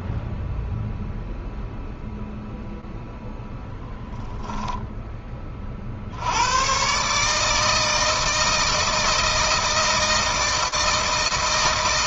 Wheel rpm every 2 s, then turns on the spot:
0, 0, 10, 120, 160, 160.
none